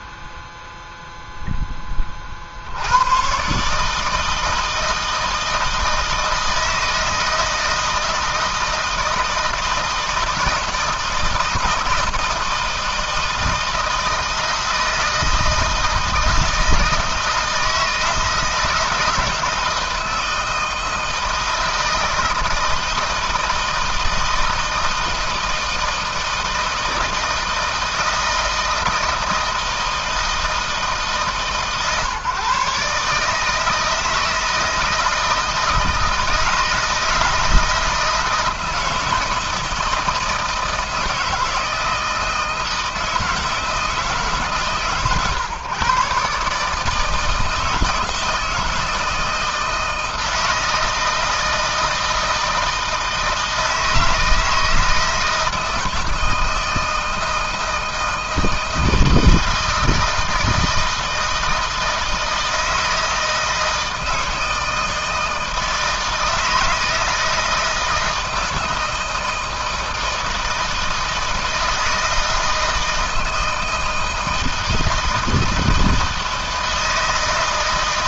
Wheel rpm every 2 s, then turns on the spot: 0, 90, 160, 160, 160, 160, 160, 160, 160, 160, 160, 160, 160, 160, 160, 160, 150, 160, 160, 160, 160, 160, 130, 150, 160, 160, 160, 160, 160, 160, 160, 160, 160, 160, 160, 160, 160, 160, 160.
none